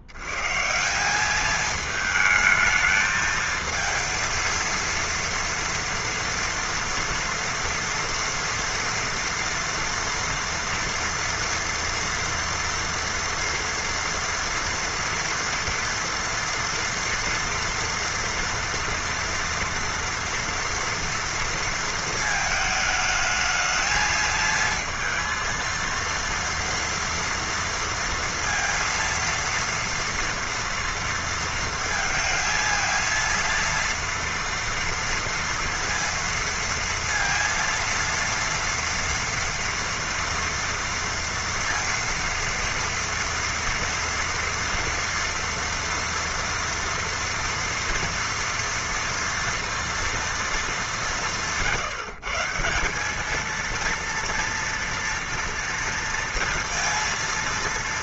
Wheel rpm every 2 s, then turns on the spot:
60, 220, 230, 230, 240, 230, 230, 230, 230, 240, 230, 220, 220, 230, 230, 230, 220, 230, 230, 230, 230, 230, 230, 230, 230, 230, 150, 230, 230.
none